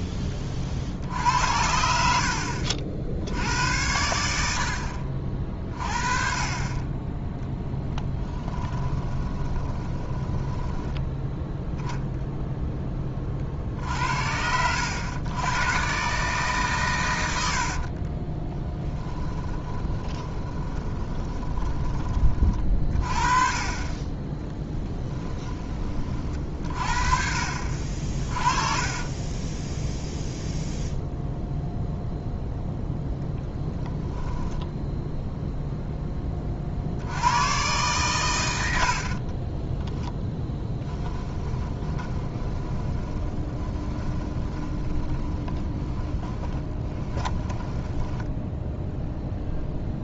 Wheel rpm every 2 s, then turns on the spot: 30, 60, 60, 30, 20, 10, 10, 80, 130, 20, 20, 40, 10, 40, 30, 0, 0, 0, 50, 80, 10, 20, 20, 20, 0.
8-12 18-22 24-26 38-48